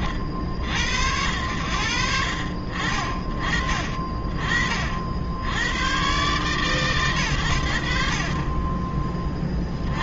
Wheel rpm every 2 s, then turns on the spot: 70, 30, 90, 110, 20.
none